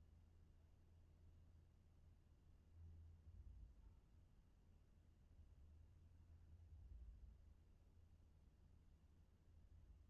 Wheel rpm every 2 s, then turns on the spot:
0, 0, 0, 0, 0.
none